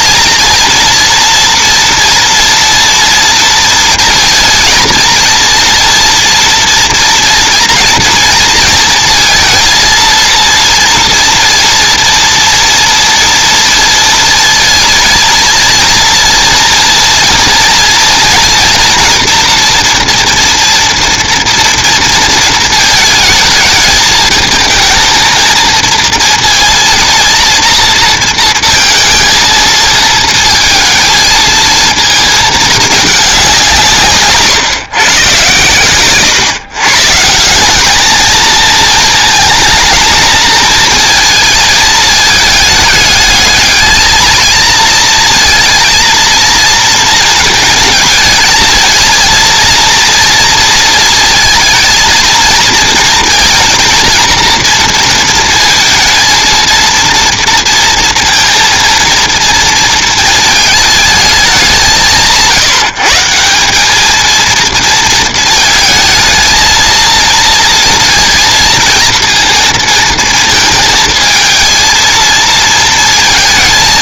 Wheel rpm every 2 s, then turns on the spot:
230, 230, 220, 230, 230, 230, 230, 230, 230, 240, 240, 220, 220, 230, 230, 230, 220, 140, 140, 220, 220, 210, 230, 230, 230, 230, 230, 230, 230, 230, 220, 170, 230, 230, 230, 230, 220.
none